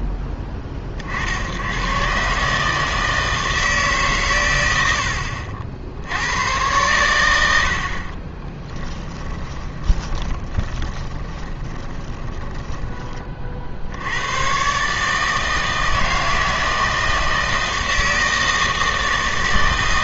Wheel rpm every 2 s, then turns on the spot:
30, 160, 90, 110, 20, 20, 20, 120, 160, 160.
8-14